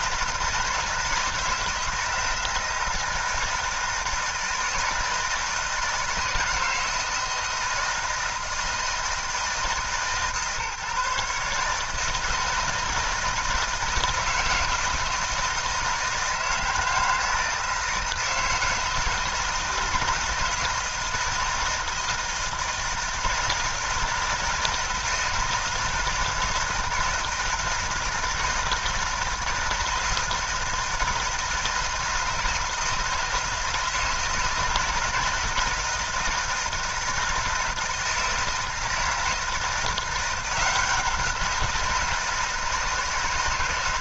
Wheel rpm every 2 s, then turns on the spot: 160, 160, 170, 160, 160, 140, 160, 160, 160, 160, 160, 160, 160, 160, 160, 160, 160, 160, 160, 160, 180, 170.
none